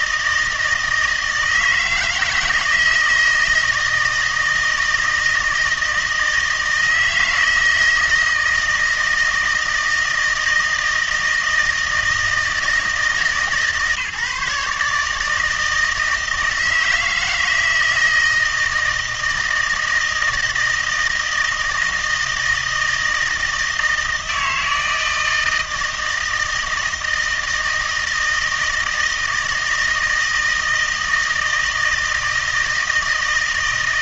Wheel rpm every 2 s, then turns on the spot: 160, 160, 160, 160, 160, 160, 160, 150, 160, 160, 160, 160, 160, 160, 160, 160, 160.
none